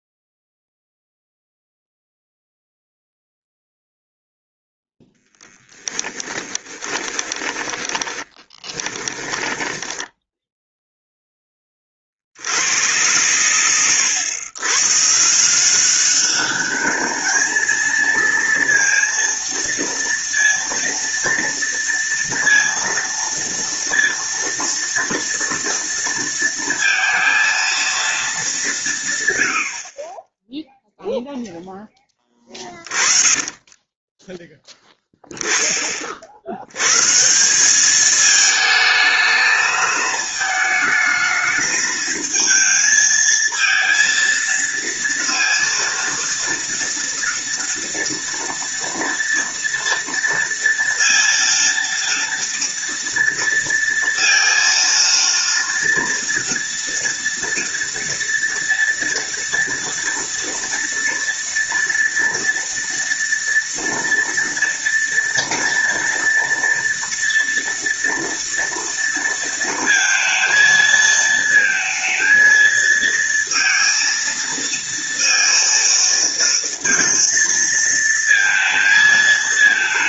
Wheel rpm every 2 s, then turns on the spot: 0, 0, 0, 30, 10, 0, 80, 110, 200, 230, 230, 230, 230, 230, 190, 0, 20, 10, 80, 220, 220, 220, 230, 230, 230, 230, 230, 230, 230, 230, 230, 230, 230, 230, 230, 230, 220, 230, 230, 230.
6-10 32-34